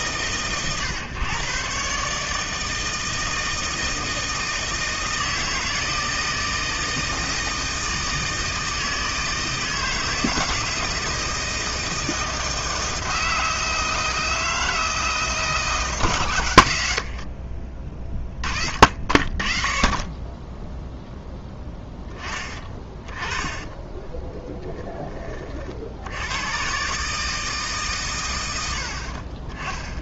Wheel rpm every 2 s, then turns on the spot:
120, 160, 160, 160, 160, 170, 160, 160, 110, 30, 0, 20, 10, 110, 80.
22-24